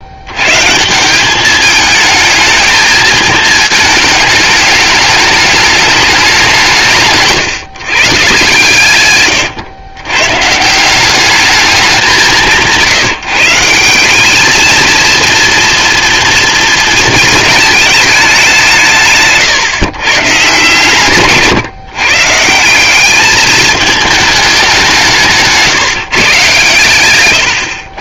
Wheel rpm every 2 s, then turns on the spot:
130, 220, 220, 180, 140, 170, 160, 220, 230, 170, 130, 170, 210, 120.
none